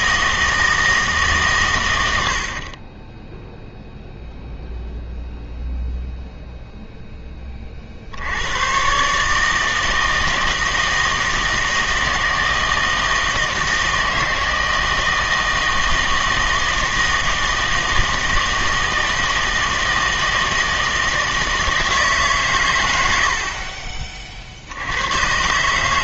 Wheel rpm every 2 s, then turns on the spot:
160, 40, 0, 0, 100, 160, 160, 160, 160, 160, 160, 130, 60.
none